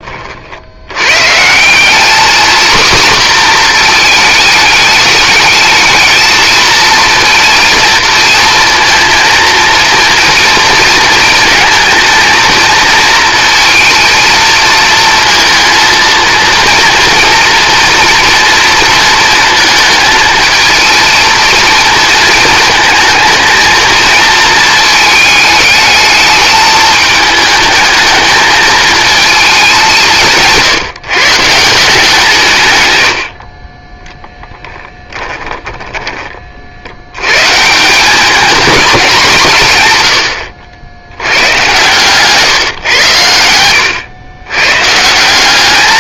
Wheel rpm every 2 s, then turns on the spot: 100, 250, 210, 230, 230, 230, 230, 230, 230, 230, 220, 230, 220, 220, 220, 150, 110, 10, 60, 210, 70, 140, 130.
34-36